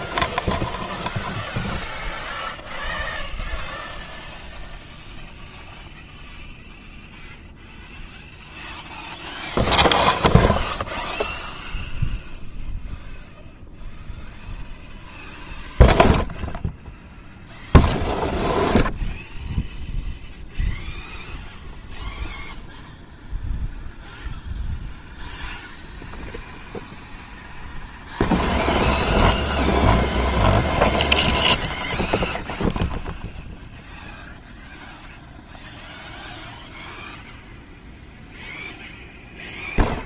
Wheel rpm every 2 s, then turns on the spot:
0, 0, 0, 0, 0, 0, 0, 0, 0, 0, 0, 0, 0, 0, 0, 0, 0, 0, 0, 0.
none